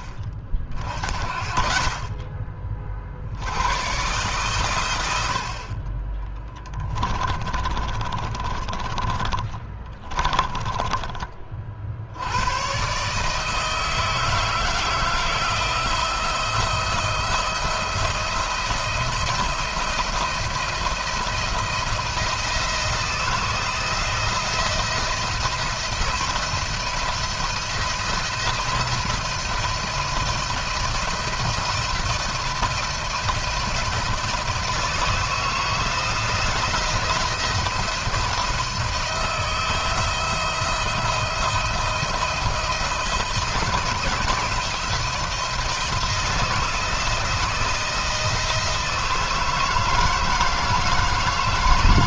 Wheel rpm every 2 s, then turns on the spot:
50, 40, 100, 20, 30, 20, 120, 160, 170, 170, 170, 160, 170, 170, 170, 170, 170, 160, 170, 170, 170, 160, 170, 170, 160, 160.
6-10